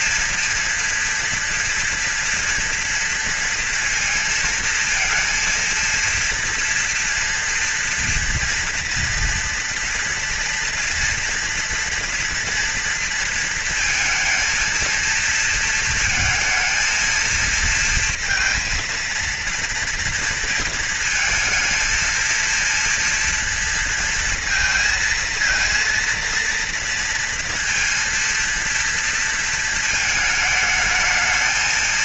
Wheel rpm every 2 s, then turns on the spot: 240, 230, 230, 230, 230, 230, 230, 230, 230, 230, 230, 230, 220, 230, 230, 220.
none